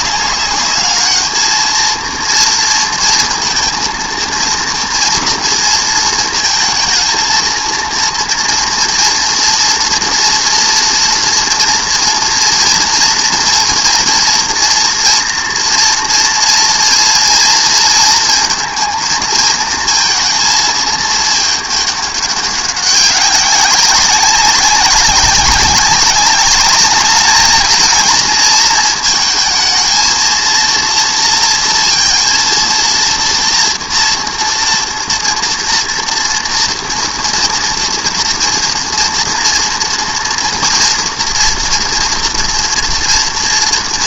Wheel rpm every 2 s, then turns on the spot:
210, 230, 230, 230, 230, 240, 240, 240, 230, 230, 220, 200, 190, 200, 220, 230, 230, 230, 230, 230, 230, 230.
none